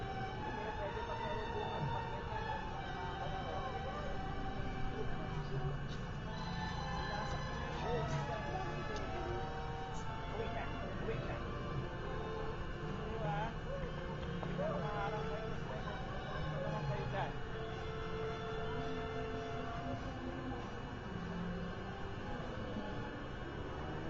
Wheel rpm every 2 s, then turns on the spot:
0, 0, 0, 0, 0, 0, 0, 0, 0, 0, 0, 0.
none